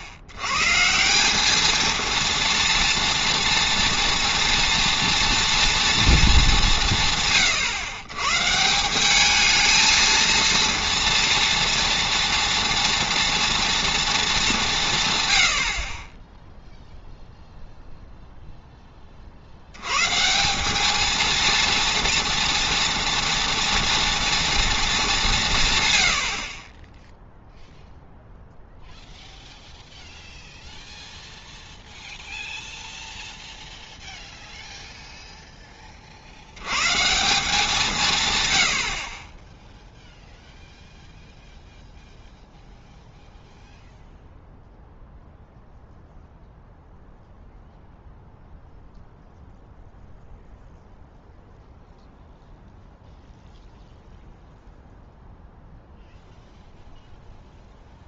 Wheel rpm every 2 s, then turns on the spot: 100, 230, 230, 200, 140, 230, 230, 200, 0, 0, 180, 230, 230, 50, 0, 0, 0, 0, 80, 110, 0, 0, 0, 0, 0, 0, 0, 0, 0.
none